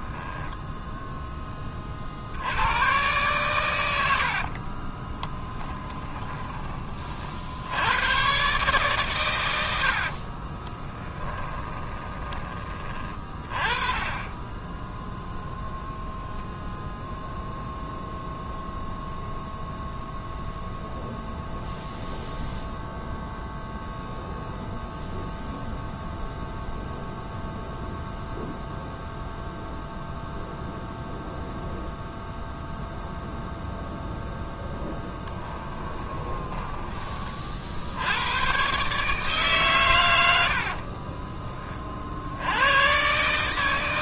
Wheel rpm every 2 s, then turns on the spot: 0, 110, 20, 40, 130, 10, 30, 10, 10, 0, 0, 0, 0, 0, 0, 0, 0, 10, 20, 140, 40, 120.
4-6 10-12 34-36 40-42